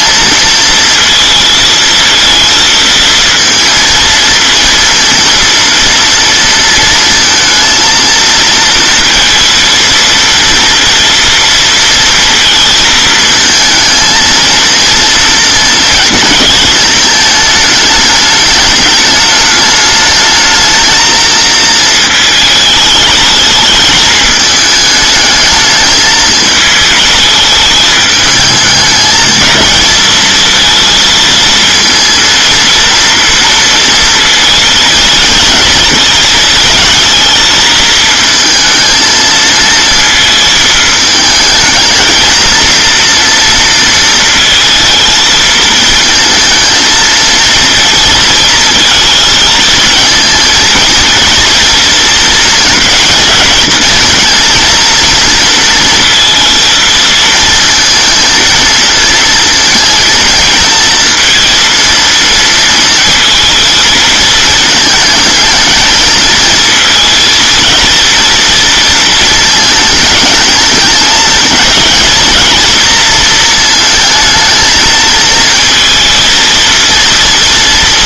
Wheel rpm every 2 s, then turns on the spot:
230, 230, 230, 230, 230, 230, 230, 230, 220, 210, 220, 210, 210, 220, 210, 230, 230, 230, 220, 220, 220, 230, 220, 230, 230, 230, 230, 230, 230, 230, 220, 230, 220, 220, 230, 210, 230, 220, 230.
none